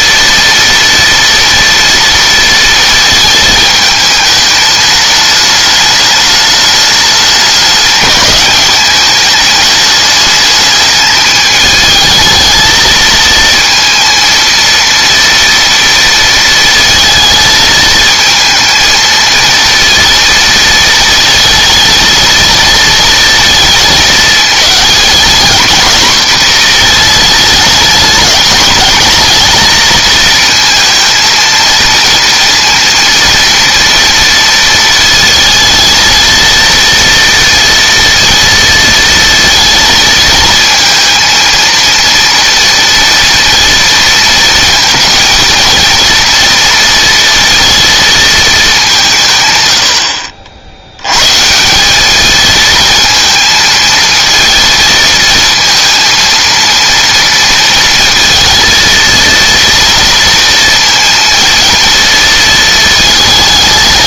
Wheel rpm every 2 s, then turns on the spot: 230, 230, 210, 210, 210, 210, 220, 230, 230, 220, 230, 220, 220, 230, 220, 230, 230, 230, 230, 230, 220, 230, 220, 230, 190, 80, 220, 230, 230, 230, 230, 230.
none